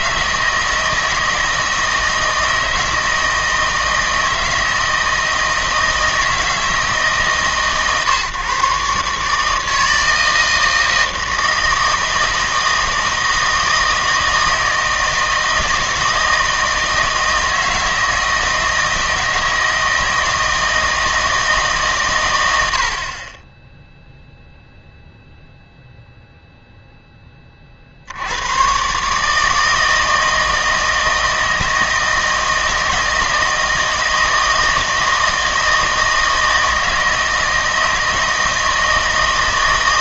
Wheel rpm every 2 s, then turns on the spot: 160, 160, 160, 160, 140, 160, 160, 160, 160, 160, 160, 80, 0, 0, 120, 160, 160, 160, 160, 160.
none